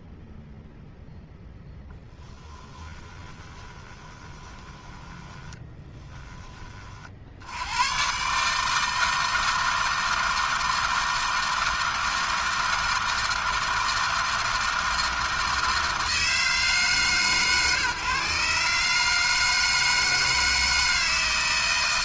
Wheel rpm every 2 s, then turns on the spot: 0, 20, 10, 90, 160, 160, 160, 160, 130, 160, 160.
2-6